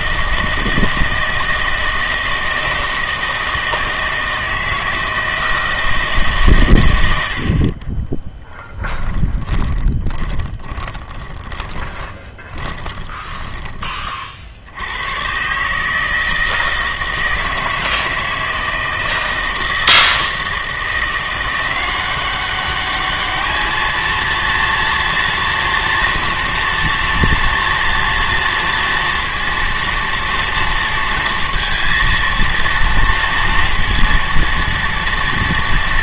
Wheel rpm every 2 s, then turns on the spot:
160, 160, 160, 120, 0, 10, 20, 80, 160, 160, 160, 200, 230, 240, 230, 230, 230, 230.
10-14